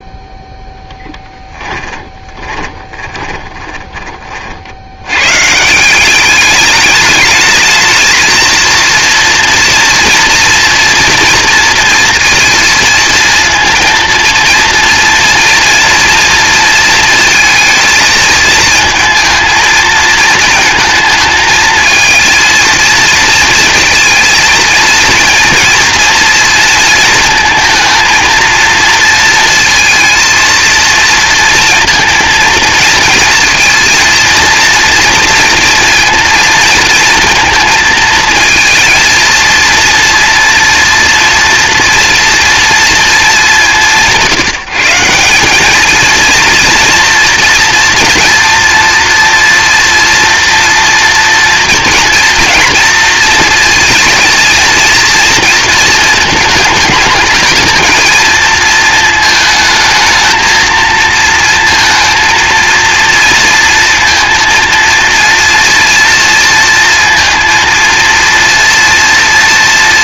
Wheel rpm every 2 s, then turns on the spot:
0, 30, 80, 200, 230, 240, 230, 230, 230, 220, 220, 230, 220, 230, 230, 230, 230, 230, 230, 230, 230, 230, 160, 230, 230, 230, 230, 230, 210, 220, 220, 230, 230, 230, 230.
2-4